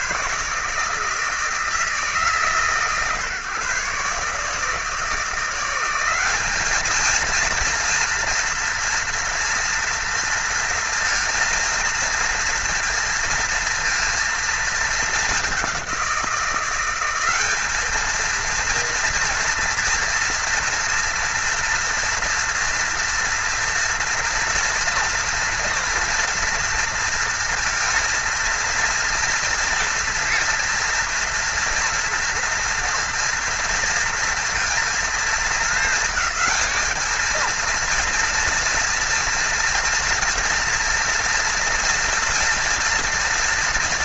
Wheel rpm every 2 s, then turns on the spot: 160, 130, 150, 210, 230, 230, 230, 220, 180, 230, 230, 230, 230, 230, 230, 230, 230, 230, 220, 230, 230, 230.
none